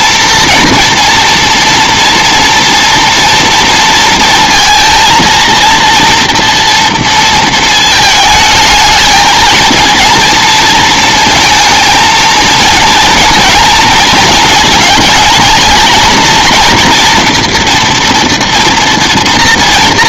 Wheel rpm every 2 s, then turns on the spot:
230, 230, 230, 230, 220, 230, 230, 220, 230, 230.
none